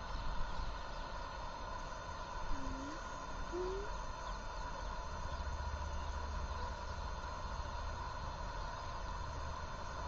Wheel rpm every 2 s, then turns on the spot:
0, 0, 0, 0, 0.
none